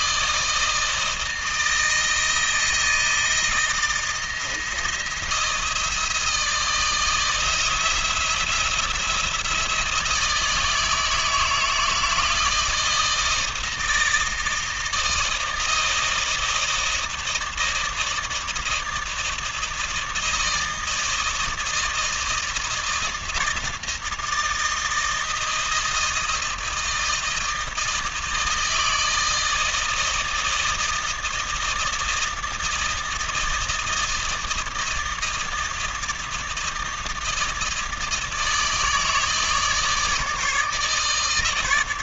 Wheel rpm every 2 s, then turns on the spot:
160, 160, 160, 160, 170, 160, 160, 160, 160, 160, 160, 160, 160, 160, 160, 160, 160, 160, 160, 160, 150.
none